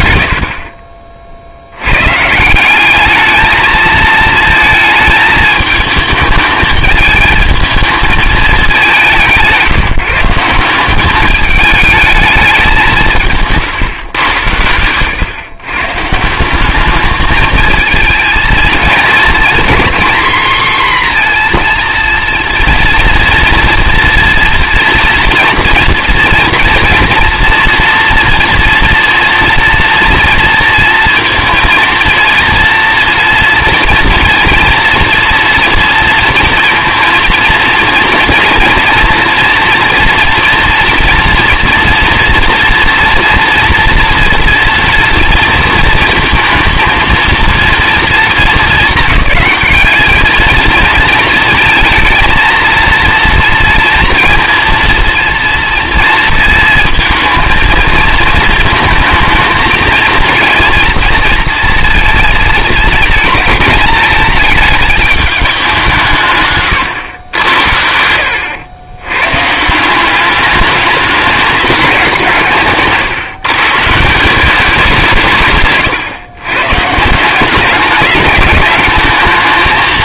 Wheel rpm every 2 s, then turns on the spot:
40, 200, 220, 220, 190, 190, 180, 110, 200, 220, 250, 240, 230, 240, 230, 230, 230, 230, 230, 230, 230, 230, 240, 230, 200, 220, 230, 230, 230, 230, 230, 220, 220, 120, 90, 210, 150, 180, 130, 210.
none